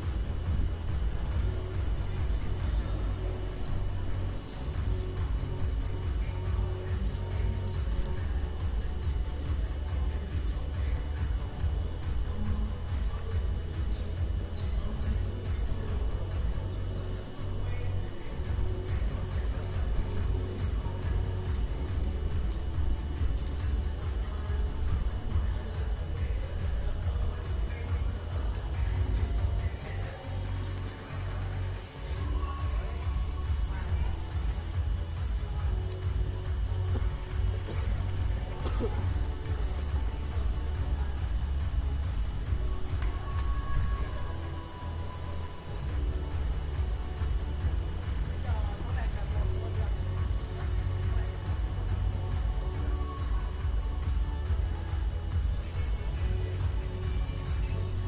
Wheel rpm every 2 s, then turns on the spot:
0, 0, 0, 0, 0, 0, 0, 0, 0, 0, 0, 0, 0, 0, 0, 0, 0, 0, 0, 0, 0, 0, 0, 0, 0, 0, 0, 0, 0.
none